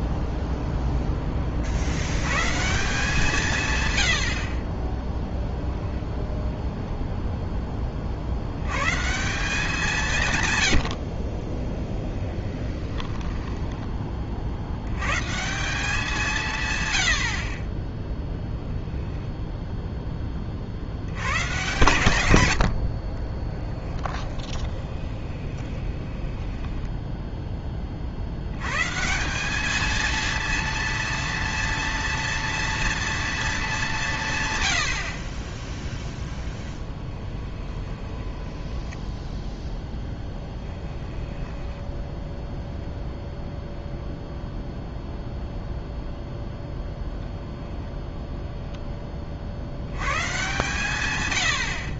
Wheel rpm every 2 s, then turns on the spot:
0, 160, 20, 0, 110, 100, 10, 80, 130, 10, 50, 80, 20, 10, 120, 230, 230, 100, 10, 10, 10, 0, 0, 0, 10, 130.
12-14 24-28 36-42